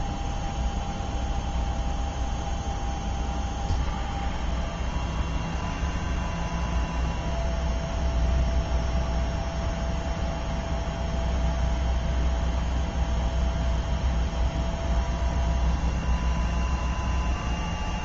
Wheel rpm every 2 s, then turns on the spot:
0, 0, 0, 0, 0, 0, 0, 0, 0.
none